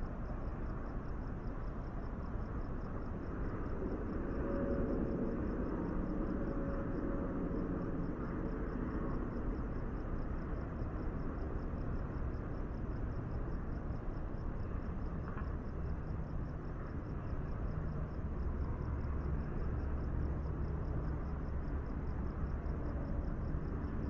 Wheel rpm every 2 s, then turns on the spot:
0, 0, 0, 0, 0, 0, 0, 0, 0, 0, 0, 0.
none